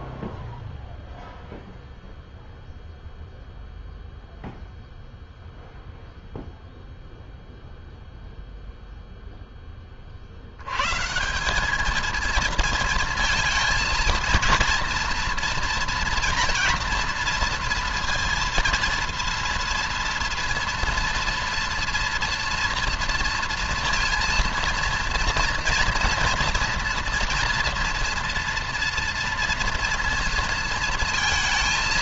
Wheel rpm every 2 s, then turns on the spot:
0, 0, 0, 0, 0, 130, 220, 230, 230, 230, 230, 230, 230, 230, 230, 230.
none